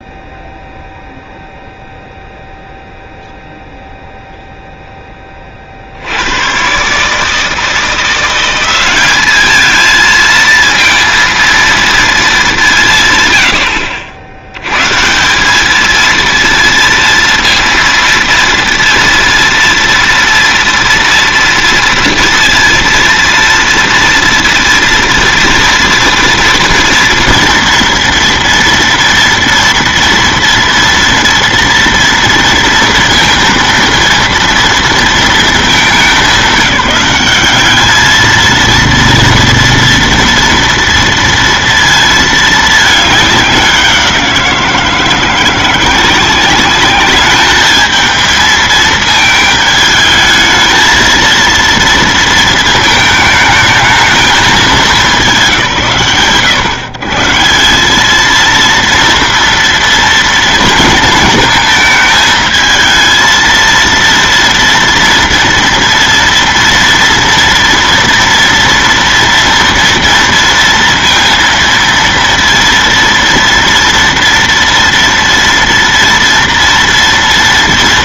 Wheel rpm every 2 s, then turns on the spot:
0, 0, 10, 140, 200, 230, 140, 160, 230, 230, 230, 230, 230, 230, 230, 230, 230, 230, 200, 230, 230, 210, 170, 200, 220, 230, 220, 210, 130, 230, 230, 220, 240, 230, 230, 230, 230, 230, 230.
none